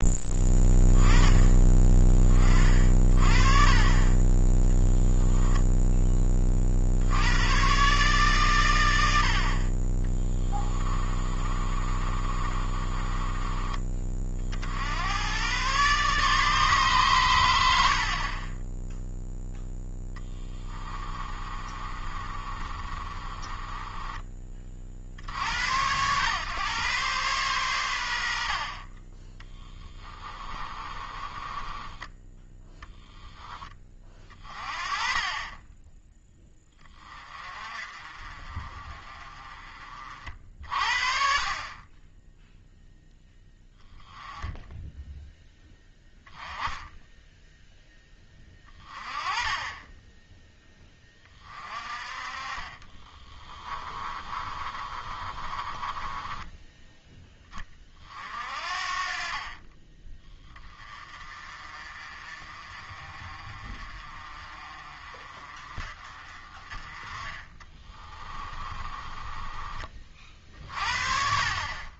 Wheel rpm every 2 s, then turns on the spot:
10, 50, 10, 50, 110, 20, 30, 80, 140, 10, 20, 30, 50, 120, 40, 20, 10, 30, 20, 30, 50, 0, 0, 10, 20, 10, 30, 30, 10, 40, 20, 40, 40, 30, 20, 40.
10-14 20-24 30-32 52-56 68-70